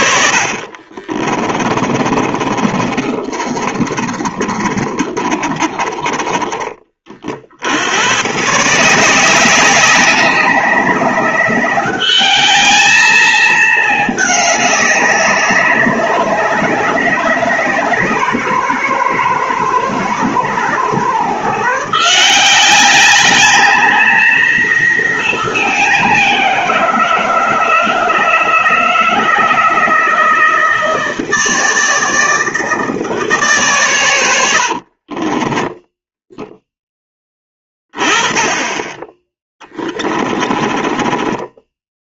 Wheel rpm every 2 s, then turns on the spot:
60, 30, 40, 30, 140, 190, 210, 210, 200, 170, 150, 180, 230, 180, 160, 160, 160, 80, 0, 20, 20.
0-8 40-42